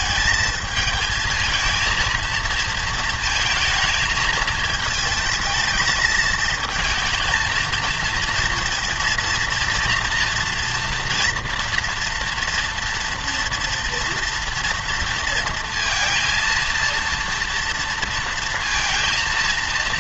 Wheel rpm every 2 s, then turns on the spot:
220, 230, 220, 220, 230, 230, 230, 230, 230, 230.
none